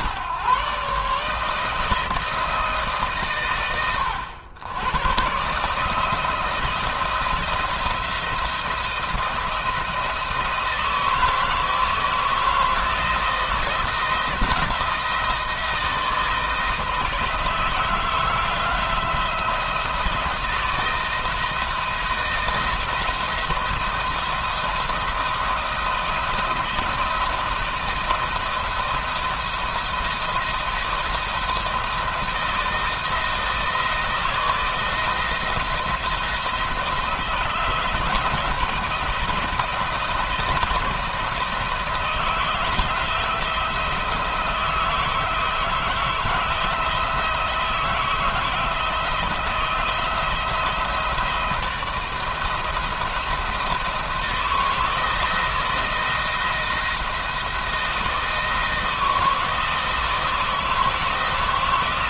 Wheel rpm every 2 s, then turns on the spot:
140, 150, 110, 160, 170, 160, 160, 170, 160, 170, 170, 170, 170, 160, 170, 170, 170, 160, 160, 160, 170, 170, 160, 160, 170, 170, 170, 160, 170, 160, 160.
none